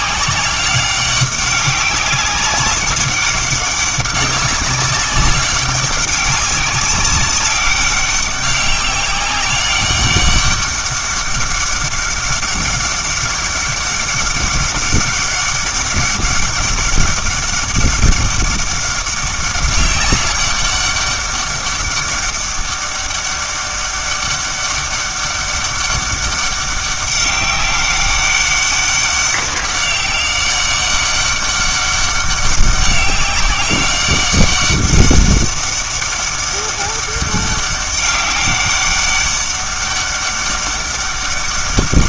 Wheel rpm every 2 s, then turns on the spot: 200, 190, 190, 200, 190, 200, 200, 200, 200, 200, 200, 200, 200, 200, 200, 200, 190, 200, 200, 200, 200.
none